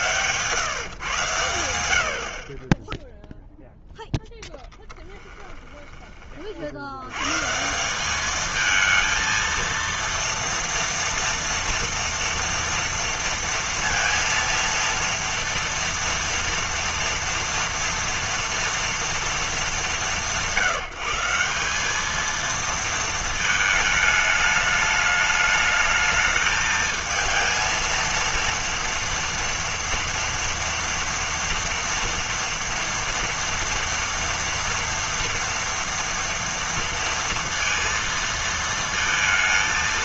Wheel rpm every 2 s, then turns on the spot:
130, 20, 10, 70, 220, 230, 230, 230, 230, 230, 160, 230, 210, 220, 230, 230, 230, 230, 230, 220.
4-6